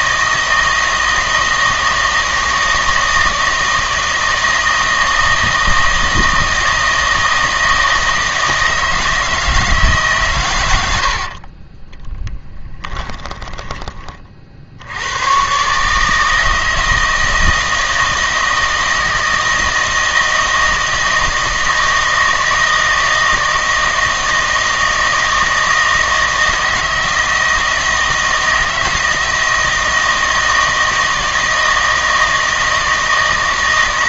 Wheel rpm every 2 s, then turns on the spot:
160, 160, 160, 160, 160, 100, 10, 60, 160, 160, 160, 160, 160, 160, 160, 160, 160.
12-14